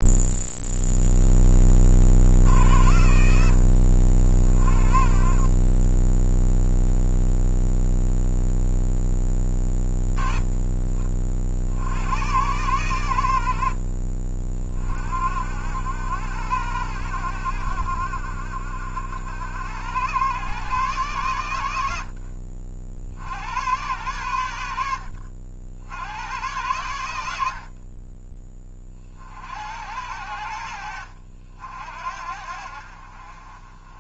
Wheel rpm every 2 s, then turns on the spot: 0, 70, 40, 0, 10, 40, 90, 50, 80, 70, 120, 70, 60, 80, 50, 70, 50.
4-6